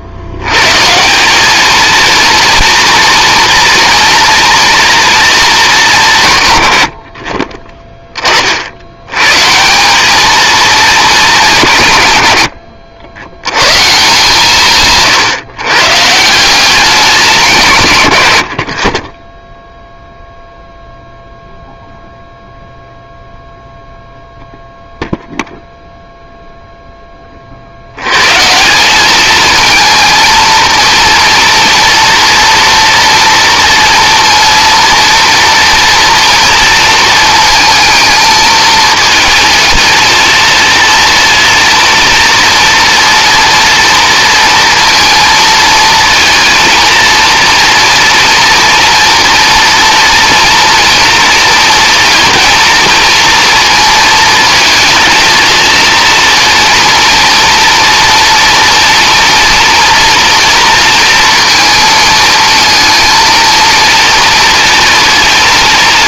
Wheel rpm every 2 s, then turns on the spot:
130, 230, 230, 90, 70, 220, 70, 150, 190, 40, 0, 0, 0, 0, 180, 230, 240, 230, 230, 220, 230, 230, 230, 230, 230, 230, 230, 220, 230, 240, 230, 220, 230.
none